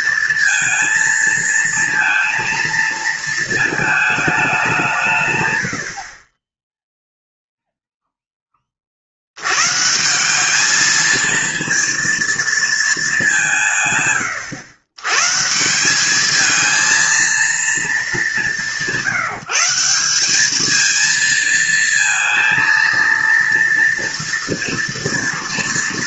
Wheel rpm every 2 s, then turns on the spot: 230, 220, 180, 10, 30, 210, 220, 100, 220, 160, 220, 230, 230.
none